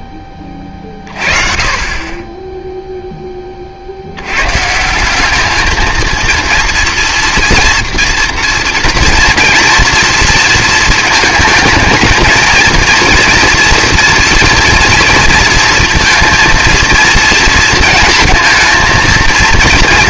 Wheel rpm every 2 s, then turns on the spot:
20, 10, 140, 230, 230, 230, 230, 230, 230, 220.
none